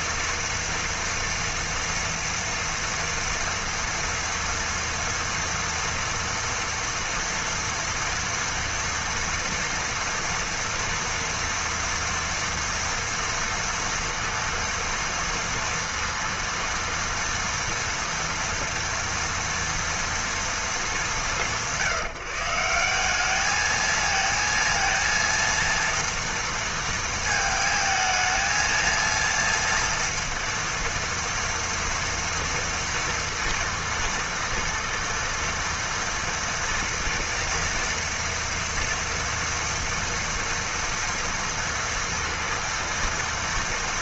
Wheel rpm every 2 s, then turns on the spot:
230, 230, 230, 240, 230, 230, 230, 230, 230, 230, 210, 170, 230, 230, 220, 230, 230, 230, 240, 230, 230, 230.
none